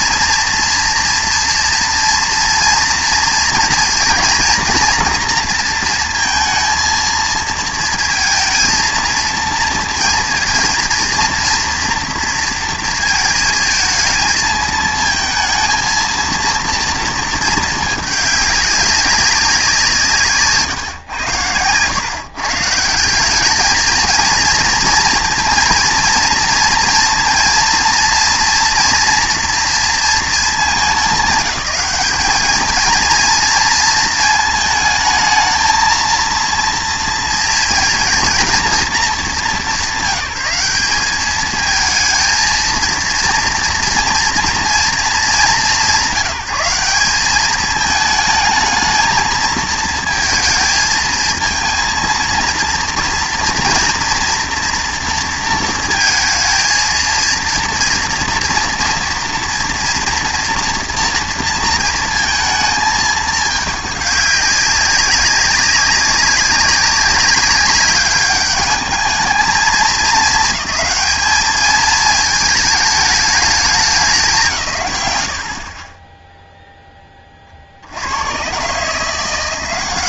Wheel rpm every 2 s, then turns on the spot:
230, 240, 230, 230, 230, 230, 230, 220, 230, 200, 120, 150, 230, 230, 230, 200, 220, 220, 230, 210, 180, 220, 230, 190, 220, 220, 230, 240, 230, 230, 240, 220, 200, 190, 210, 210, 210, 150, 10, 140.
none